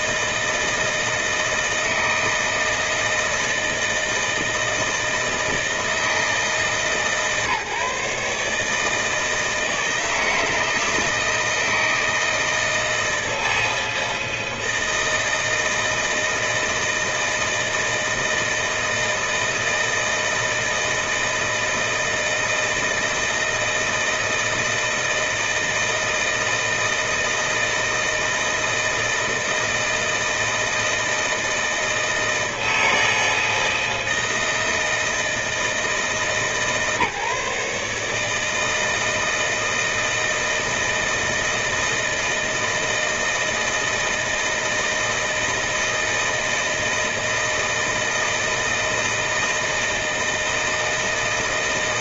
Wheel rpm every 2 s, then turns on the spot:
160, 160, 160, 150, 150, 160, 160, 160, 160, 160, 160, 160, 160, 160, 160, 160, 160, 160, 140, 160, 160, 160, 160, 160, 160, 160.
none